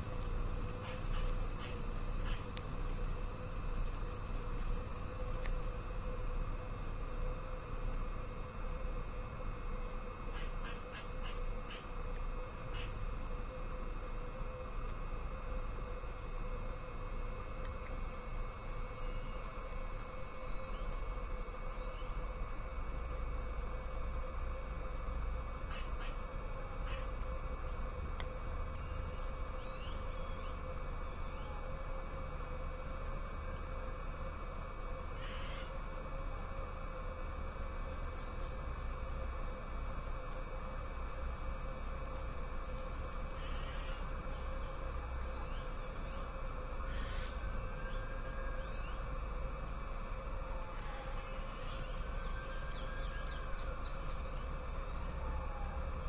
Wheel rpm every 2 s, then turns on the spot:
0, 0, 0, 0, 0, 0, 0, 0, 0, 0, 0, 0, 0, 0, 0, 0, 0, 0, 0, 0, 0, 0, 0, 0, 0, 0, 0, 0.
none